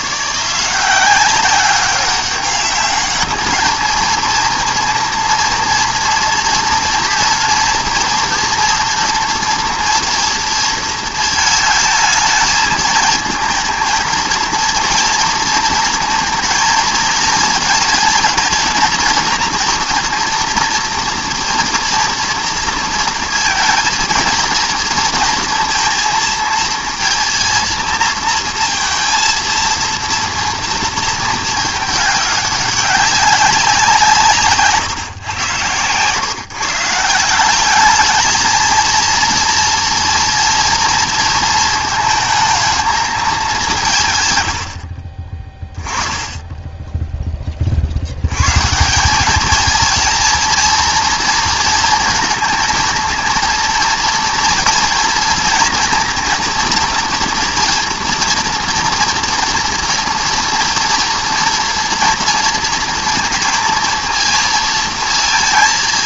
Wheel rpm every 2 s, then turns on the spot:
180, 200, 230, 230, 230, 230, 220, 230, 220, 230, 230, 230, 230, 230, 230, 230, 190, 130, 150, 220, 230, 220, 70, 10, 170, 230, 230, 230, 230, 240, 240, 230, 230.
46-48